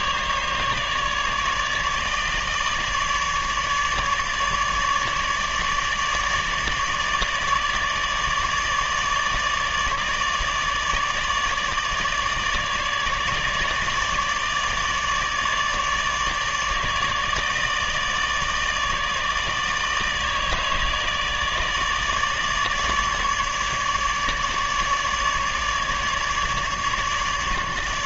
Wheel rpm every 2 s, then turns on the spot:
150, 150, 150, 150, 150, 150, 150, 150, 150, 150, 150, 150, 150, 150.
none